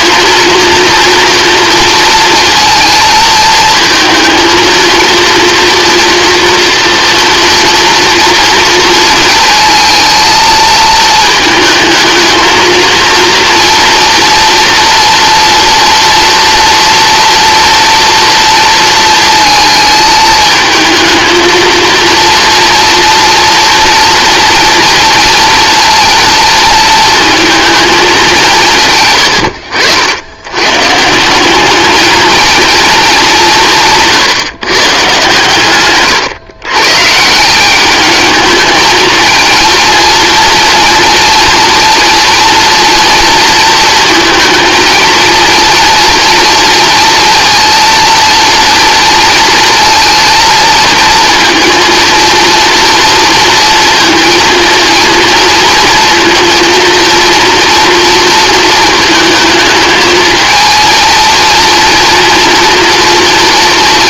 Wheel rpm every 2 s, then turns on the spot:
230, 230, 230, 230, 230, 220, 220, 240, 230, 230, 220, 230, 230, 230, 160, 130, 230, 150, 130, 220, 230, 230, 230, 230, 230, 230, 230, 230, 230, 220, 220, 240.
none